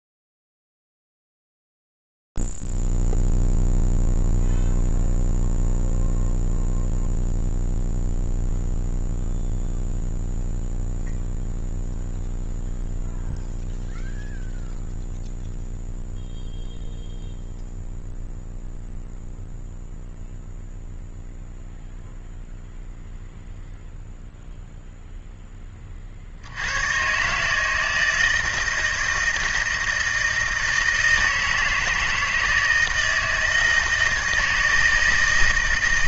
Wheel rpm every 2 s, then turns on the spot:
0, 0, 0, 0, 0, 0, 0, 0, 0, 0, 0, 0, 0, 90, 160, 160, 160, 160.
none